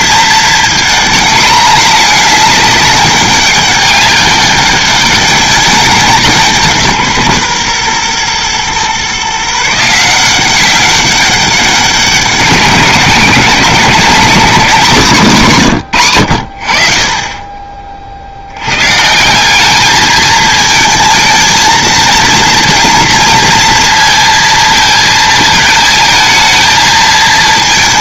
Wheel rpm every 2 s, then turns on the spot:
220, 200, 200, 170, 130, 190, 180, 180, 50, 120, 220, 240, 220, 220.
none